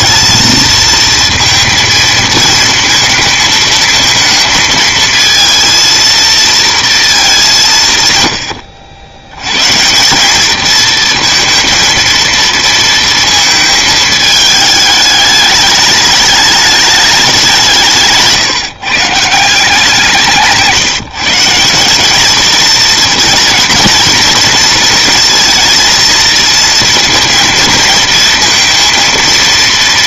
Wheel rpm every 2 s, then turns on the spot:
220, 220, 220, 230, 90, 210, 230, 210, 210, 150, 160, 220, 230, 230, 230.
20-22